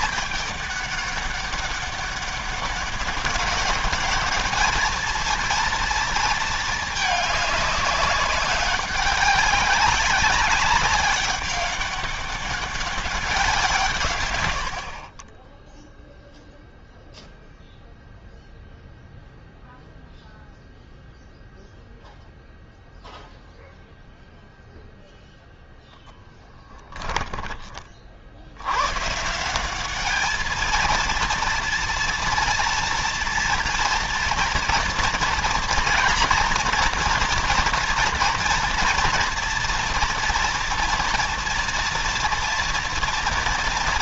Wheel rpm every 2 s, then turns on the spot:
200, 200, 220, 220, 200, 200, 200, 60, 0, 0, 0, 0, 0, 10, 100, 220, 230, 230, 230, 230, 230, 230.
14-16 26-28